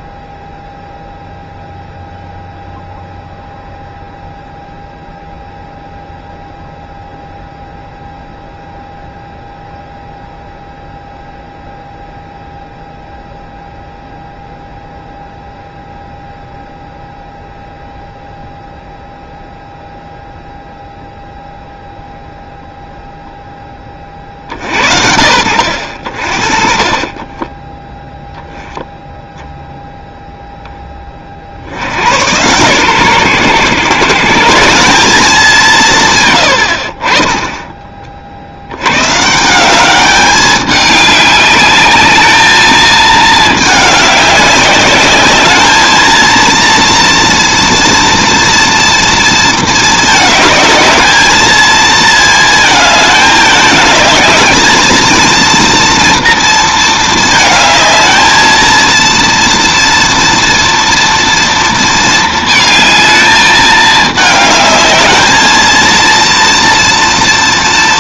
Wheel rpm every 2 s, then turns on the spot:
0, 0, 0, 0, 0, 0, 0, 0, 0, 0, 0, 0, 70, 40, 10, 10, 120, 190, 70, 80, 200, 220, 200, 230, 230, 210, 220, 220, 230, 230, 230, 220, 210, 230.
none